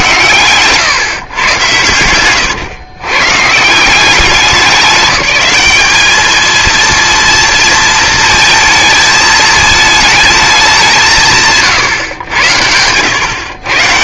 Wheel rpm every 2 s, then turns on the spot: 120, 110, 200, 230, 220, 200, 90.
none